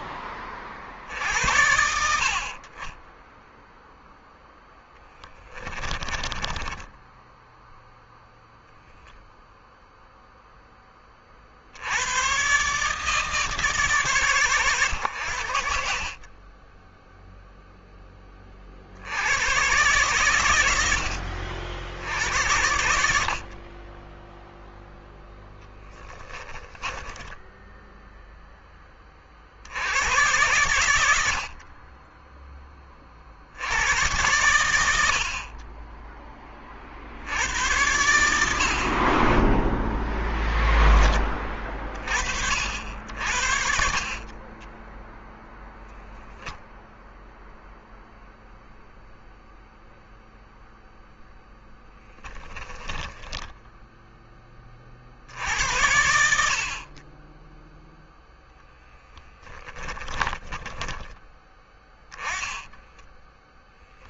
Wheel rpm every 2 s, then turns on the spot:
30, 50, 0, 10, 0, 10, 130, 100, 10, 40, 90, 70, 0, 10, 10, 100, 20, 90, 40, 70, 10, 60, 20, 0, 0, 0, 20, 30, 50, 0, 20, 10.
6-8 26-28 44-46 52-54 60-64